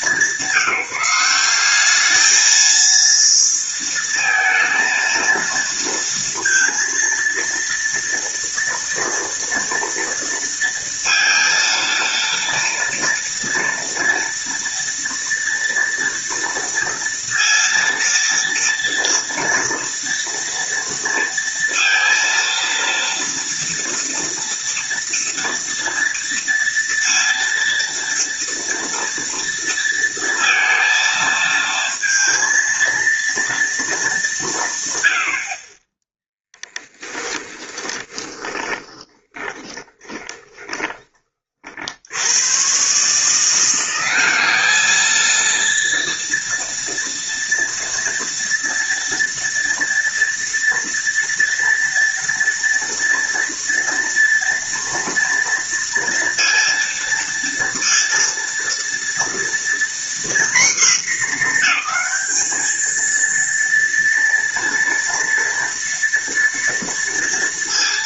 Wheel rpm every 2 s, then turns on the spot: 180, 230, 230, 230, 230, 230, 230, 230, 230, 230, 230, 230, 230, 230, 230, 230, 230, 110, 10, 20, 30, 140, 220, 230, 230, 230, 230, 230, 230, 230, 220, 220, 230, 230.
36-40